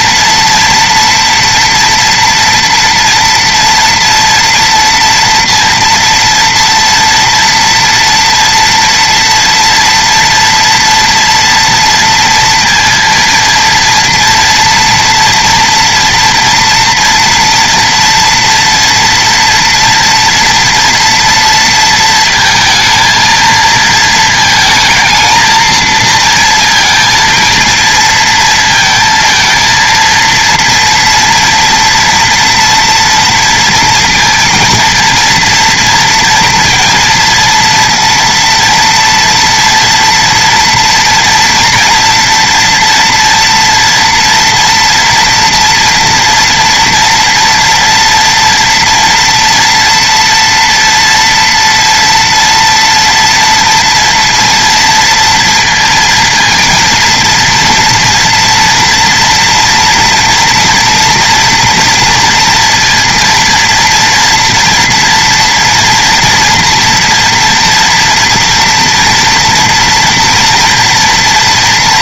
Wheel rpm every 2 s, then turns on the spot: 240, 230, 230, 230, 230, 240, 230, 230, 230, 230, 240, 220, 220, 230, 230, 230, 230, 230, 230, 230, 230, 230, 230, 230, 230, 230, 230, 230, 230, 230, 230, 230, 230, 230, 230, 230.
none